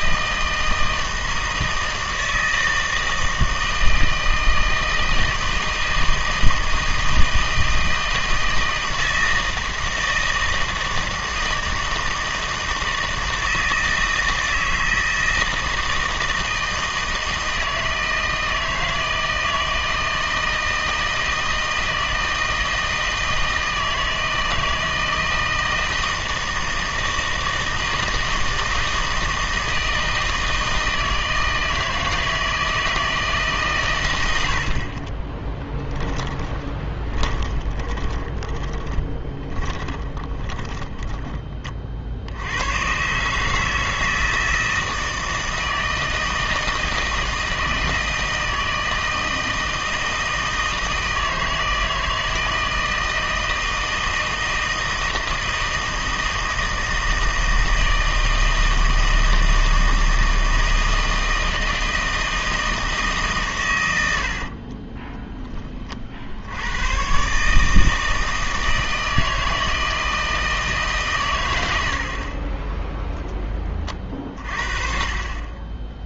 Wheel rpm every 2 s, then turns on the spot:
160, 160, 160, 160, 160, 160, 160, 160, 160, 160, 160, 160, 160, 160, 160, 160, 160, 50, 20, 20, 10, 100, 160, 160, 160, 160, 160, 160, 160, 160, 160, 160, 30, 100, 160, 150, 20, 40.
36-42 64-66